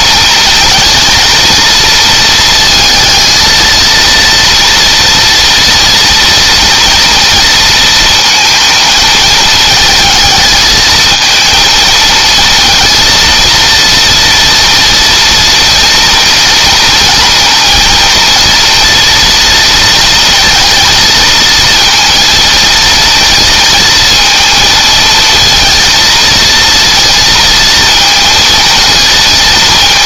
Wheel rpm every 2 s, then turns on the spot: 230, 220, 230, 230, 220, 220, 230, 230, 230, 230, 230, 230, 230, 230, 230.
none